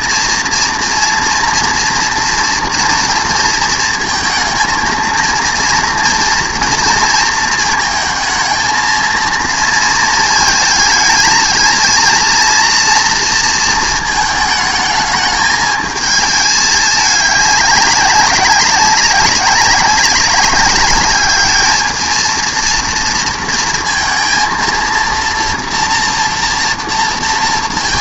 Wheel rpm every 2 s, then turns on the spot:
230, 230, 230, 230, 220, 220, 230, 220, 210, 190, 200, 230, 230, 230.
none